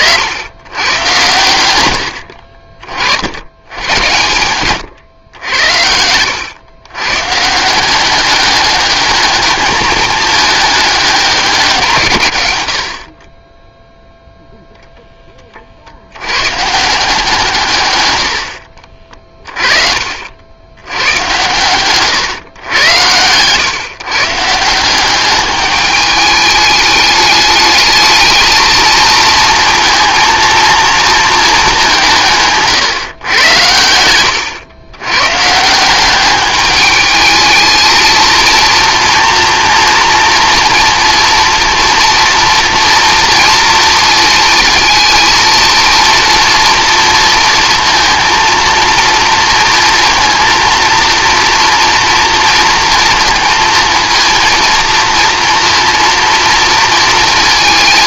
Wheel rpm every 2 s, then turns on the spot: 100, 50, 110, 110, 210, 200, 70, 0, 160, 50, 90, 110, 180, 210, 220, 230, 130, 110, 210, 230, 230, 230, 230, 240, 230, 230, 230, 230, 230.
18-20